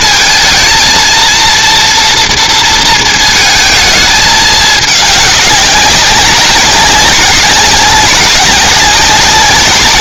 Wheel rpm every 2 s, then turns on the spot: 230, 220, 200, 190, 200.
none